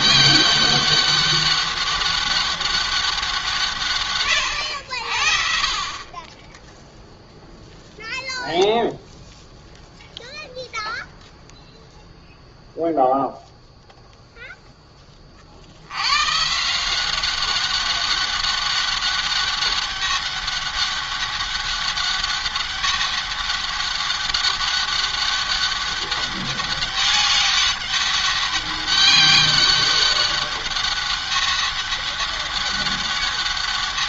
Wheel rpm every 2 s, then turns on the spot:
200, 200, 90, 10, 0, 0, 0, 10, 160, 200, 200, 200, 200, 200, 200, 200, 200.
none